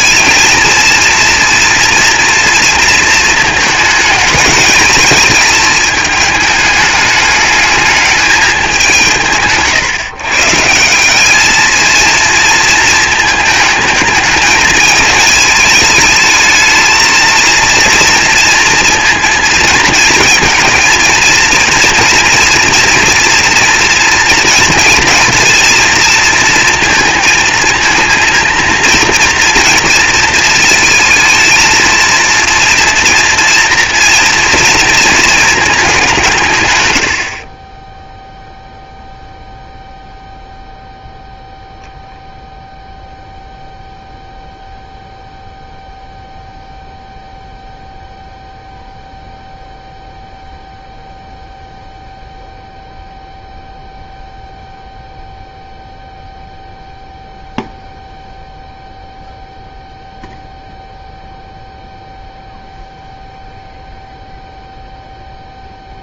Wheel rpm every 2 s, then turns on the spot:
230, 230, 210, 210, 200, 160, 230, 220, 220, 230, 220, 240, 230, 230, 230, 220, 230, 230, 120, 0, 0, 0, 0, 0, 0, 0, 0, 0, 0, 0, 0, 0, 0.
none